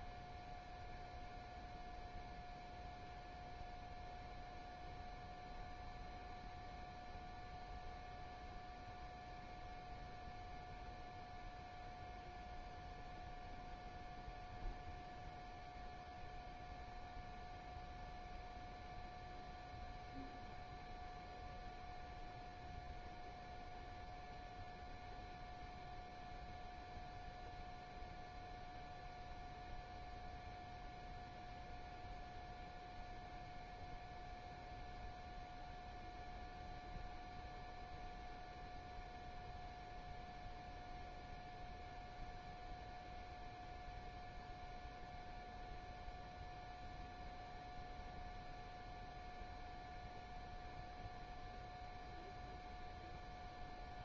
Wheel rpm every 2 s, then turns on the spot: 0, 0, 0, 0, 0, 0, 0, 0, 0, 0, 0, 0, 0, 0, 0, 0, 0, 0, 0, 0, 0, 0, 0, 0, 0, 0, 0.
none